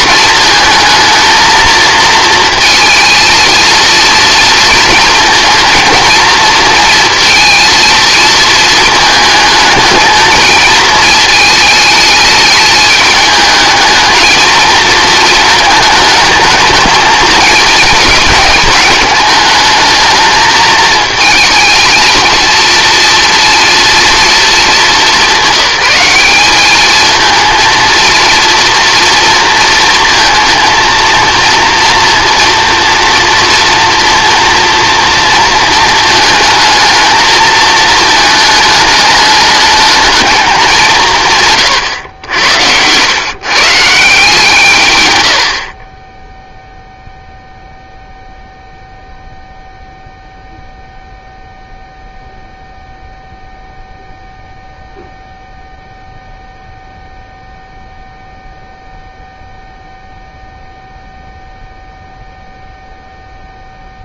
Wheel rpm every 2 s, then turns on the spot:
230, 230, 230, 230, 220, 220, 210, 230, 220, 210, 220, 240, 210, 210, 230, 230, 240, 230, 220, 210, 190, 100, 140, 0, 0, 0, 0, 0, 0, 0, 0, 0.
none